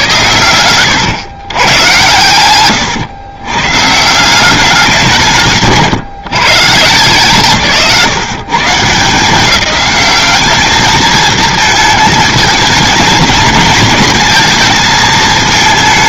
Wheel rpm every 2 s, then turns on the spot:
110, 110, 190, 140, 140, 210, 220, 220.
2-4